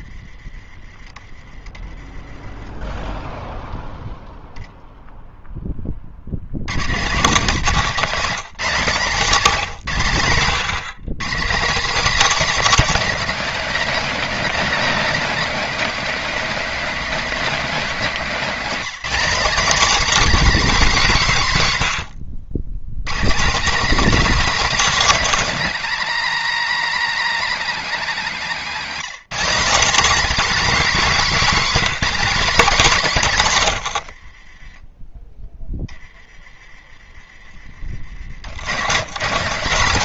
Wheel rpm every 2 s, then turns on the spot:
0, 130, 210, 120, 300, 270, 260, 230, 290, 80, 300, 290, 250, 280, 260, 50, 20, 60, 260, 200.
30-32 34-36